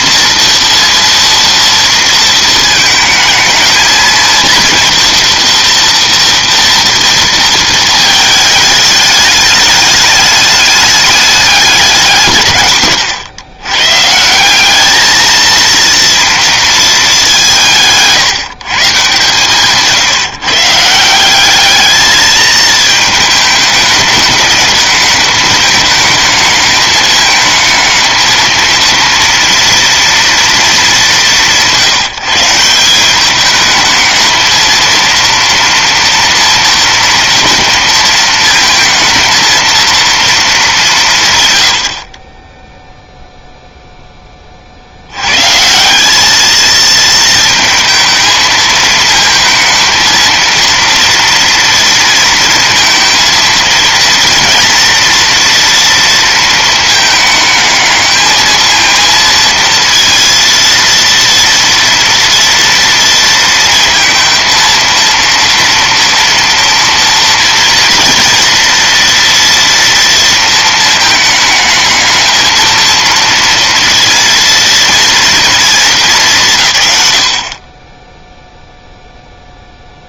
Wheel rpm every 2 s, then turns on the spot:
230, 220, 240, 220, 210, 190, 110, 230, 180, 140, 200, 210, 210, 220, 230, 170, 210, 230, 230, 230, 120, 0, 130, 230, 220, 230, 230, 230, 220, 230, 230, 230, 230, 230, 230, 220, 230, 230, 70, 0.
none